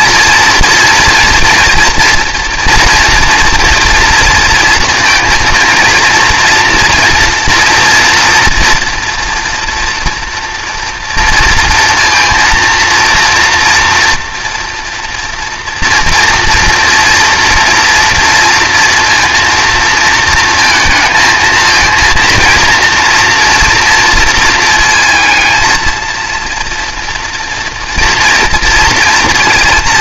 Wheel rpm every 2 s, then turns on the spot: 230, 230, 230, 240, 230, 230, 230, 230, 230, 230, 220, 230, 230, 230, 230.
none